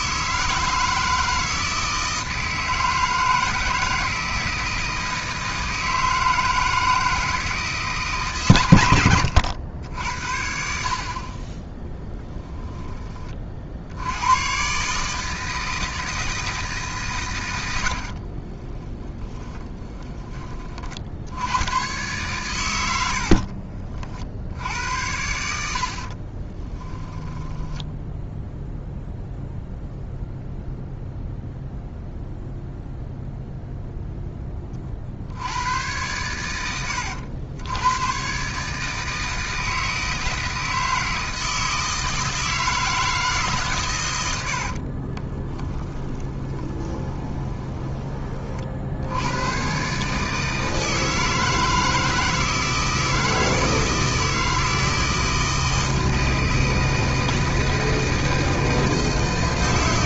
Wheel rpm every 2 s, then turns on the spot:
160, 160, 160, 160, 110, 50, 20, 140, 140, 20, 50, 100, 80, 10, 0, 0, 0, 50, 90, 150, 160, 160, 50, 20, 60, 160, 160, 160, 160, 160.
18-20 26-28 44-48